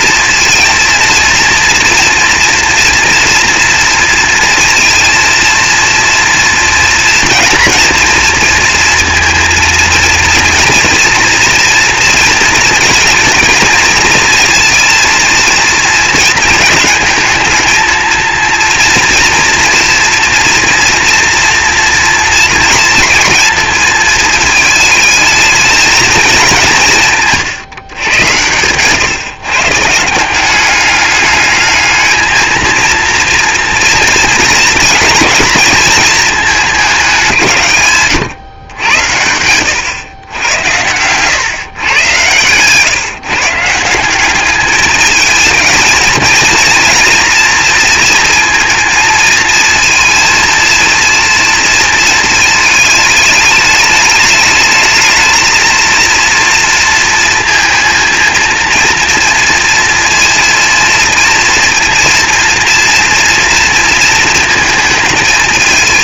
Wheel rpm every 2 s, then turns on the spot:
230, 240, 230, 230, 230, 230, 220, 230, 220, 230, 230, 230, 220, 190, 120, 190, 230, 230, 200, 110, 100, 130, 210, 230, 230, 230, 210, 210, 230, 230, 230, 230, 230.
none